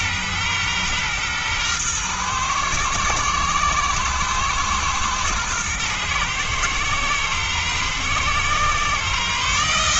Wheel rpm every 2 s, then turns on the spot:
120, 120, 120, 120, 130.
none